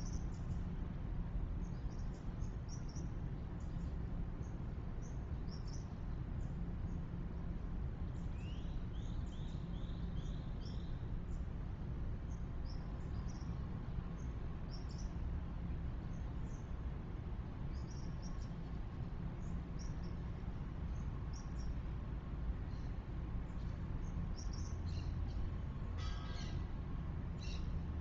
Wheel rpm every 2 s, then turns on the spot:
0, 0, 0, 0, 0, 0, 0, 0, 0, 0, 0, 0, 0, 0.
none